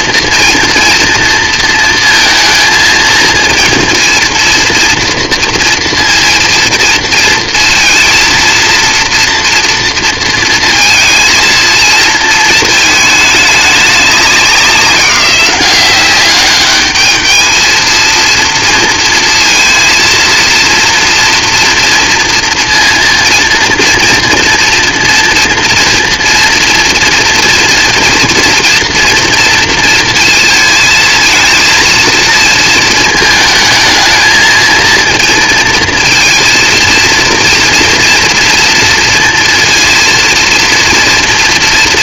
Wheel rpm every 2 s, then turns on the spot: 230, 230, 230, 230, 230, 230, 220, 190, 200, 230, 230, 230, 230, 230, 230, 230, 230, 220, 230, 230, 230.
none